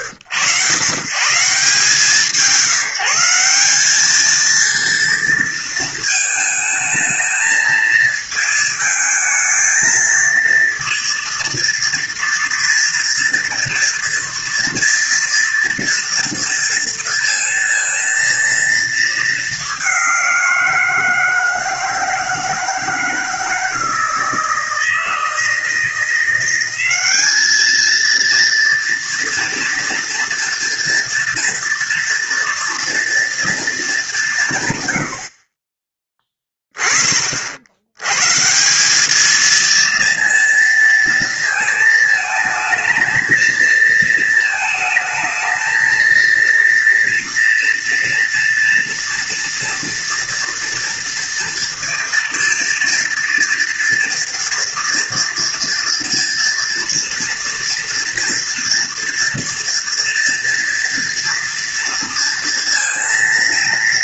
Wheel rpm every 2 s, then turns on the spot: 100, 170, 230, 220, 220, 230, 230, 230, 230, 220, 160, 160, 160, 200, 230, 230, 230, 80, 30, 200, 230, 230, 220, 230, 230, 230, 230, 230, 230, 230, 230, 230.
none